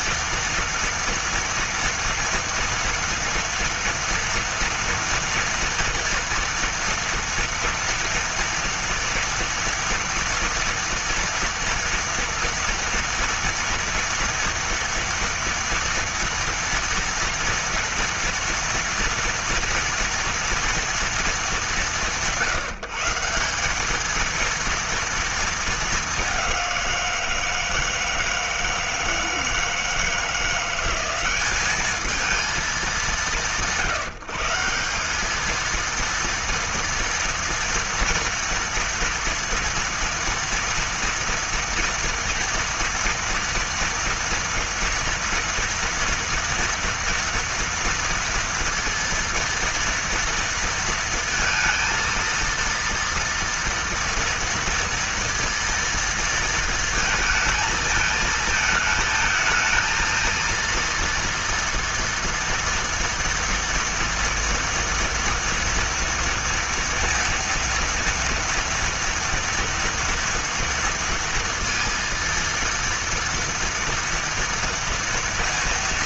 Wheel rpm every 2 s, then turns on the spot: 230, 230, 230, 230, 230, 230, 230, 230, 230, 230, 230, 170, 230, 190, 160, 170, 210, 170, 230, 230, 230, 230, 230, 230, 230, 230, 230, 230, 230, 220, 230, 240, 240, 230, 230, 230, 230, 230.
none